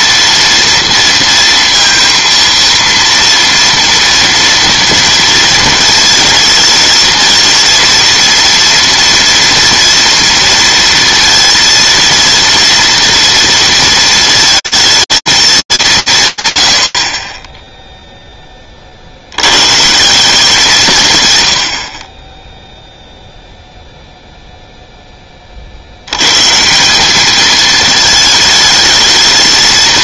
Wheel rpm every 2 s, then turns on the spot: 230, 230, 230, 220, 230, 230, 230, 220, 80, 70, 120, 0, 0, 190, 220.
none